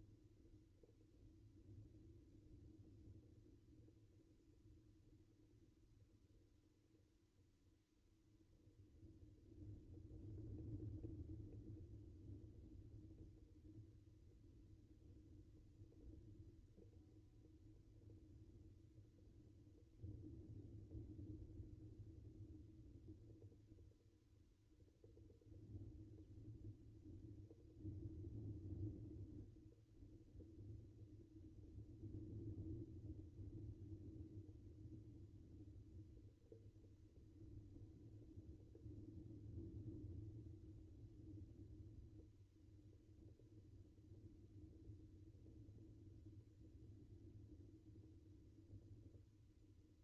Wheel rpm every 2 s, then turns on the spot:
0, 0, 0, 0, 0, 0, 0, 0, 0, 0, 0, 0, 0, 0, 0, 0, 0, 0, 0, 0, 0, 0, 0, 0, 0.
none